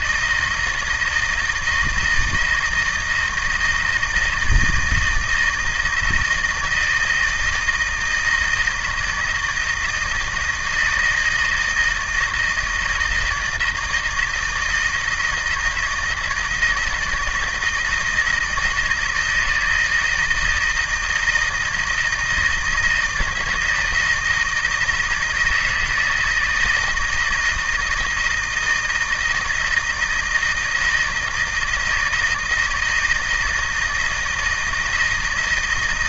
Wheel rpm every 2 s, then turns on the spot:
160, 160, 160, 160, 170, 160, 160, 160, 160, 160, 160, 160, 160, 160, 160, 160, 160, 160.
none